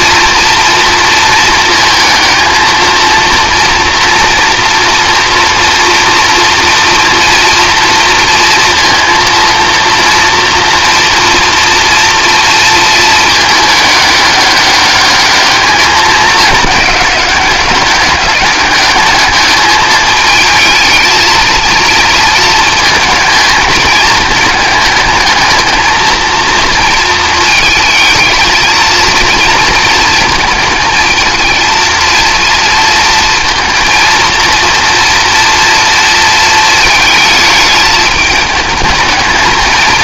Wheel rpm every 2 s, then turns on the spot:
230, 230, 240, 240, 230, 240, 230, 200, 210, 200, 220, 230, 220, 220, 220, 220, 230, 230, 230, 210.
none